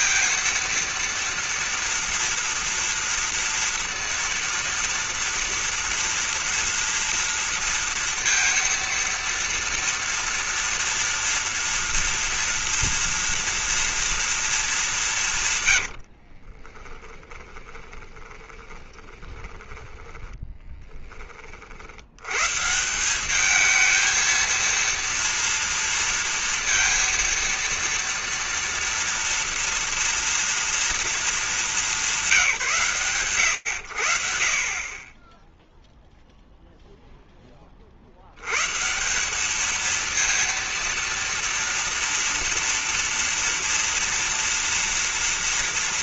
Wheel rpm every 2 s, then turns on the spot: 230, 230, 230, 230, 230, 240, 230, 170, 20, 20, 20, 170, 230, 230, 240, 230, 140, 20, 0, 120, 230, 230, 230.
16-20